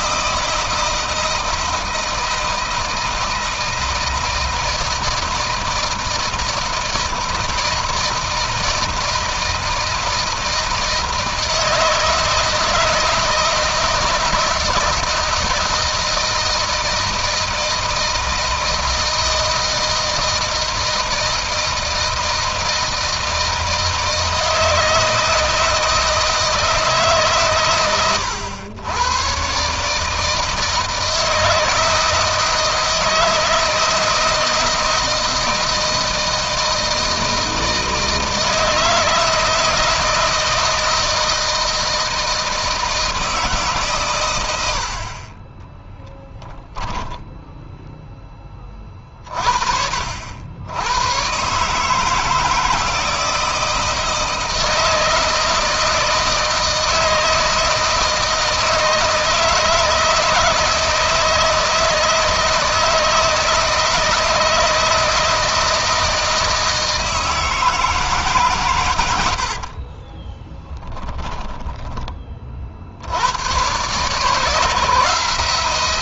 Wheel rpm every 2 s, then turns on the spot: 160, 160, 160, 160, 160, 160, 160, 160, 160, 160, 160, 160, 160, 150, 120, 160, 160, 160, 160, 160, 160, 160, 60, 10, 30, 110, 160, 160, 160, 160, 160, 160, 160, 160, 110, 10, 80, 160.
46-48 70-72